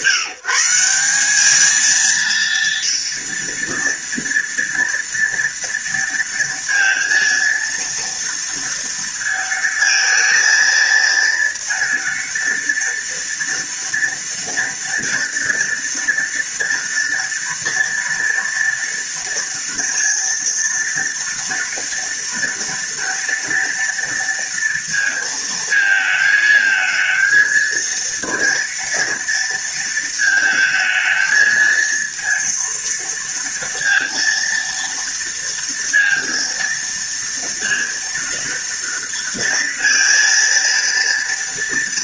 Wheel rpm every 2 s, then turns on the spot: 190, 230, 230, 230, 230, 230, 230, 230, 240, 230, 230, 230, 230, 220, 230, 220, 230, 230, 230, 230, 230.
none